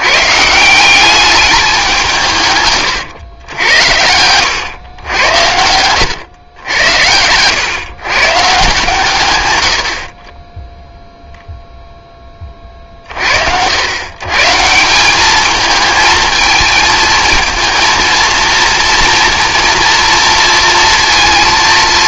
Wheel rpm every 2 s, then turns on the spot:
160, 130, 110, 90, 150, 10, 30, 160, 220, 230, 230.
none